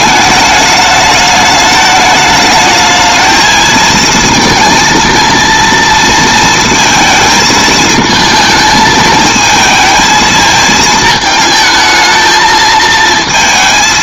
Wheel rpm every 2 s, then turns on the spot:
210, 220, 230, 230, 220, 220, 220.
none